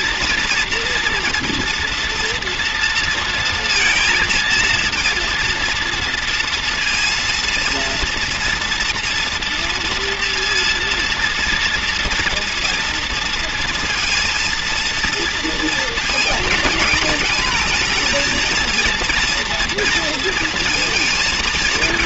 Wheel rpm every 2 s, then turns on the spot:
230, 230, 230, 230, 230, 230, 240, 240, 220, 230, 230.
none